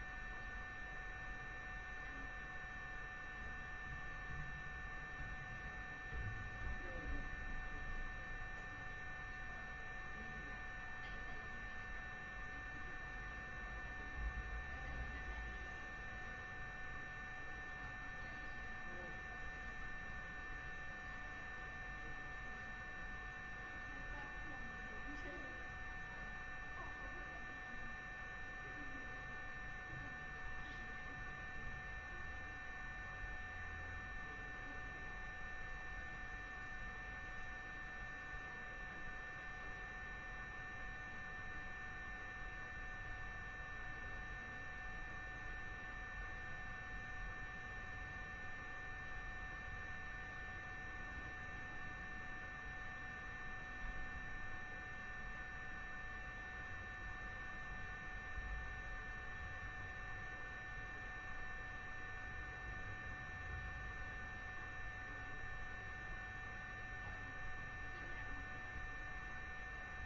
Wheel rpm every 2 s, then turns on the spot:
0, 0, 0, 0, 0, 0, 0, 0, 0, 0, 0, 0, 0, 0, 0, 0, 0, 0, 0, 0, 0, 0, 0, 0, 0, 0, 0, 0, 0, 0, 0, 0, 0, 0, 0.
none